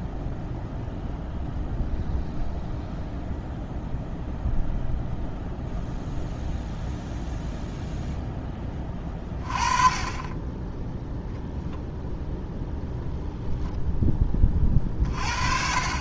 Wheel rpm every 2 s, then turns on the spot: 0, 0, 0, 0, 10, 10, 0, 30.
none